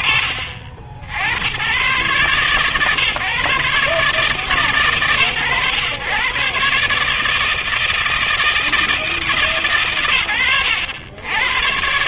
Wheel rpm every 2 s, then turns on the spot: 60, 130, 100, 150, 160, 90.
none